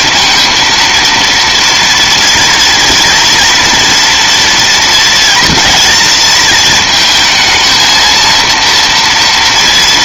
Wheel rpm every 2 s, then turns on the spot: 240, 240, 230, 230, 230.
none